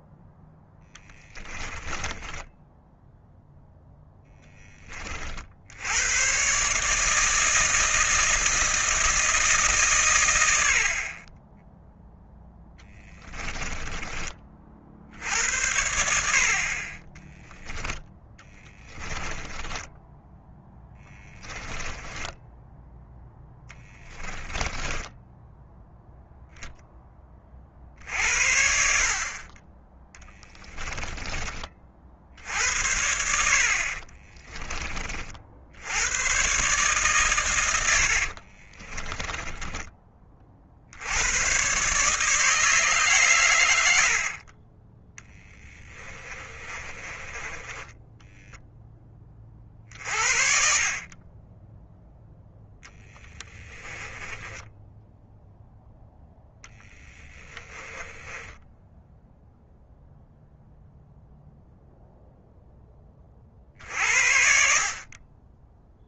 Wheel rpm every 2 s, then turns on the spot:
10, 0, 20, 150, 160, 70, 10, 60, 40, 20, 10, 0, 10, 10, 60, 10, 70, 30, 140, 30, 70, 150, 20, 20, 10, 40, 10, 10, 10, 10, 0, 10, 40.
0-2 12-14 18-22 24-26 30-32 38-40 46-48 54-60